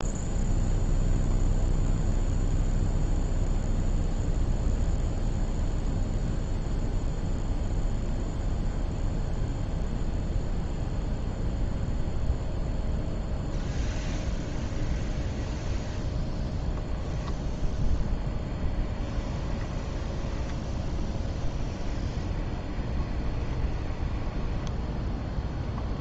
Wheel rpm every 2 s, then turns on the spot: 0, 0, 0, 0, 0, 0, 0, 0, 0, 10, 10, 20, 10.
18-26